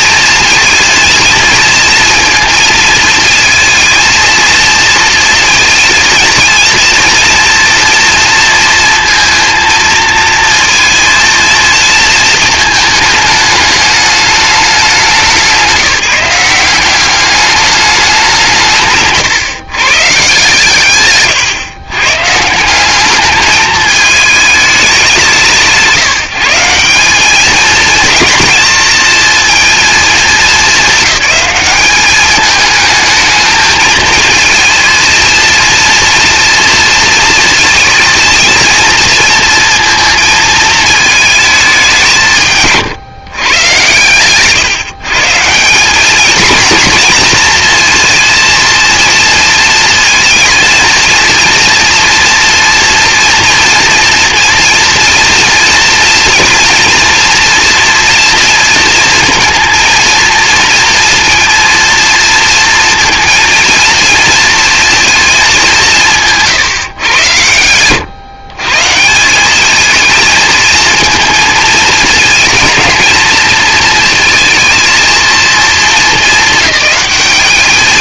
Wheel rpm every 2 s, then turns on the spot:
230, 230, 230, 230, 230, 230, 220, 200, 190, 150, 140, 180, 200, 180, 230, 210, 210, 230, 230, 230, 220, 160, 150, 230, 230, 230, 230, 230, 230, 230, 230, 230, 230, 150, 140, 220, 220, 220, 200.
none